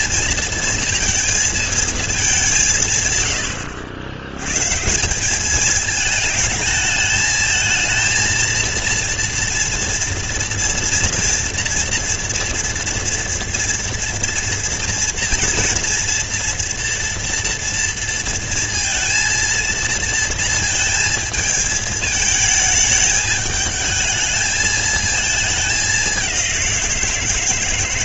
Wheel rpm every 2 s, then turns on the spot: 230, 210, 100, 220, 230, 230, 230, 230, 230, 230, 230, 220, 220, 200.
none